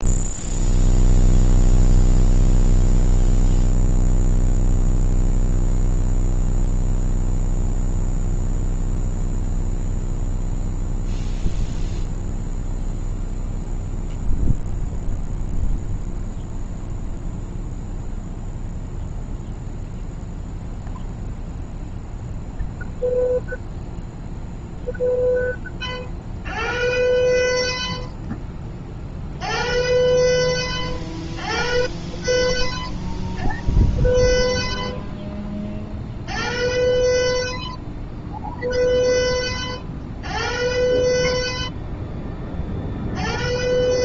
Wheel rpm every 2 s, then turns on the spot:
0, 0, 0, 0, 0, 0, 0, 0, 0, 0, 0, 0, 0, 0, 0, 0, 0, 0, 0, 0, 0, 0.
none